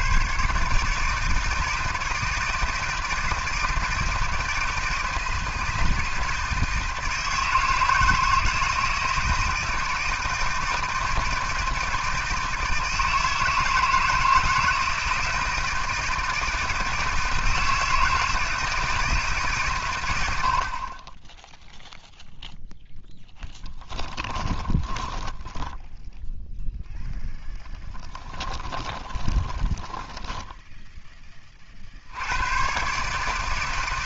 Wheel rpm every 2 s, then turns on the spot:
150, 160, 160, 160, 160, 160, 160, 160, 160, 160, 40, 0, 20, 0, 30, 10, 130.
24-26 28-30